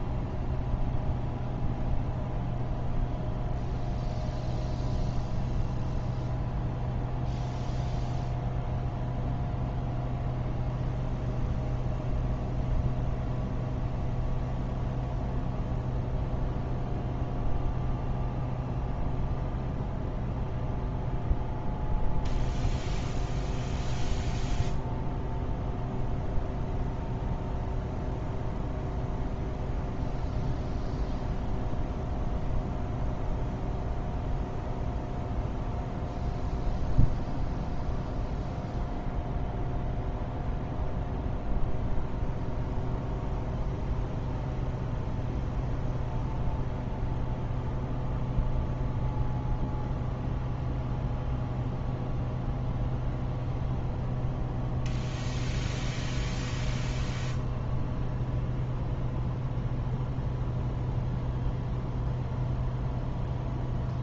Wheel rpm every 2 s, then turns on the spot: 0, 0, 0, 0, 0, 0, 0, 0, 0, 0, 0, 0, 0, 0, 0, 0, 0, 0, 0, 0, 0, 0, 0, 0, 0, 0, 0, 0, 0, 0, 0, 0.
none